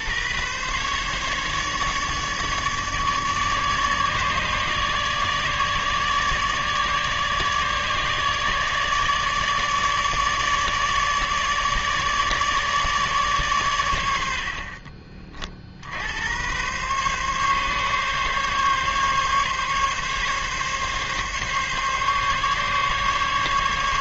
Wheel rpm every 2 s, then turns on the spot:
140, 150, 150, 150, 150, 150, 150, 50, 130, 140, 140, 140.
none